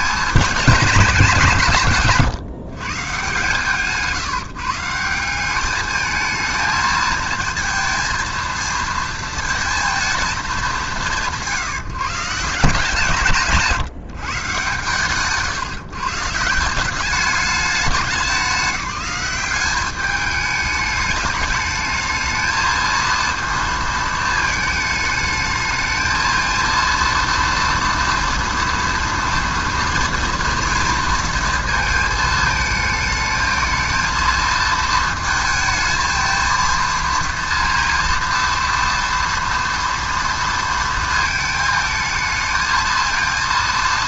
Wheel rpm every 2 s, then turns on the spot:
210, 130, 150, 220, 230, 210, 160, 150, 150, 190, 210, 220, 220, 220, 230, 230, 220, 220, 230, 230, 230, 220.
none